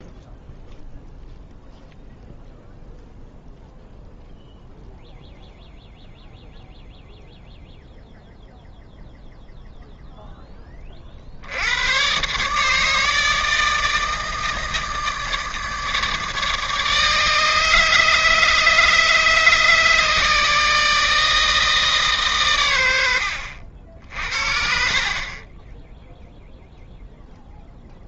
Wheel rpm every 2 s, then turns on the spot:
0, 0, 0, 0, 0, 10, 150, 160, 150, 150, 150, 130, 60, 0.
none